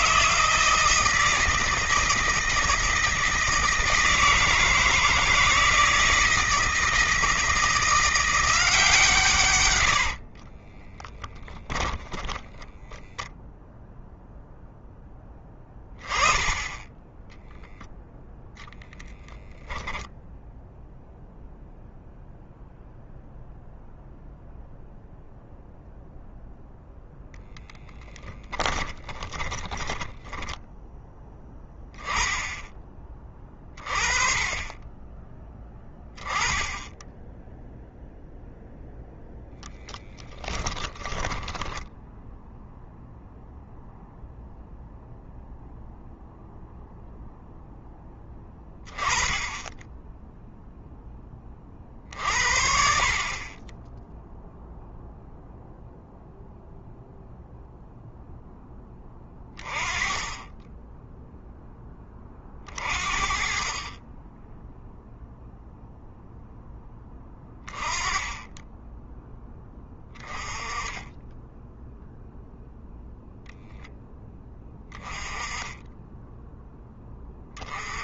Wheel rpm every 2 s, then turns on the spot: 160, 160, 160, 160, 150, 10, 10, 10, 10, 20, 0, 0, 0, 0, 20, 10, 20, 20, 10, 0, 10, 0, 0, 0, 10, 10, 50, 0, 0, 10, 10, 30, 0, 10, 10, 10, 0, 20, 10.
10-12 18-20 28-30 40-42